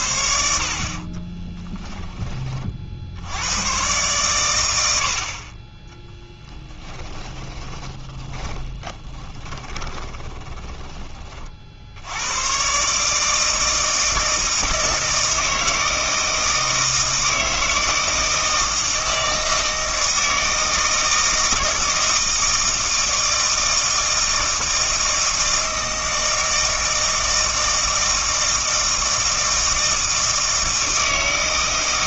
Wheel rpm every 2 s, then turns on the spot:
50, 40, 100, 10, 20, 20, 130, 160, 160, 160, 160, 160, 160, 160, 160, 160.
6-12